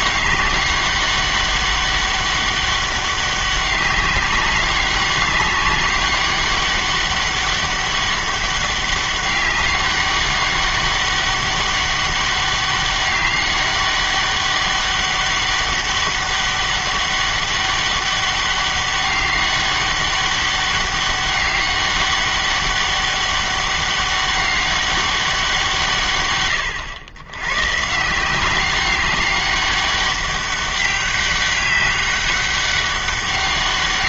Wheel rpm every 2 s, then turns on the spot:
200, 200, 200, 200, 200, 200, 200, 200, 200, 200, 200, 200, 200, 110, 190, 200, 200.
none